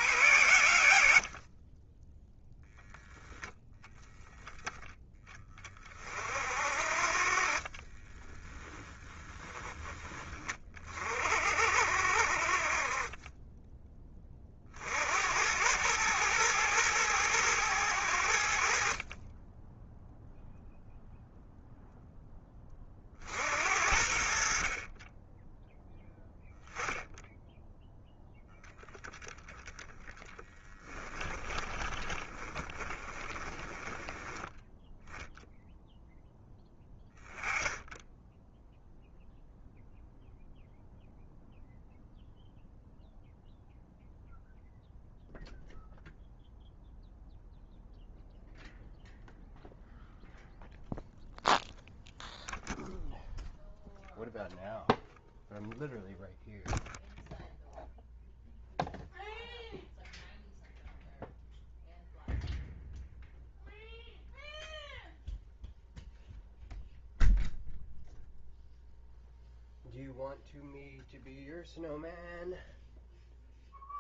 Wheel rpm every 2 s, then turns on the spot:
60, 0, 20, 50, 10, 40, 30, 60, 110, 40, 0, 40, 30, 10, 10, 10, 20, 0, 10, 0, 0, 0, 0, 0, 0, 0, 0, 0, 0, 0, 0, 0, 0, 0, 0, 0, 0.
0-2 8-10 30-34